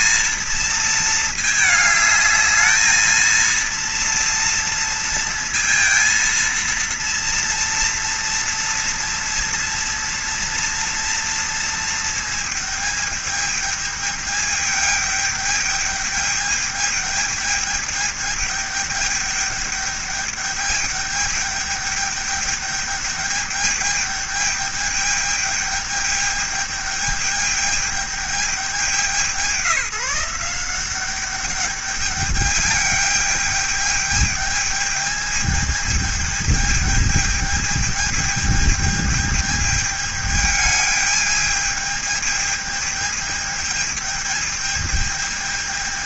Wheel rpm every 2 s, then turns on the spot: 220, 220, 230, 230, 230, 230, 220, 210, 210, 210, 210, 210, 210, 200, 190, 180, 210, 210, 210, 210, 210, 210, 220.
none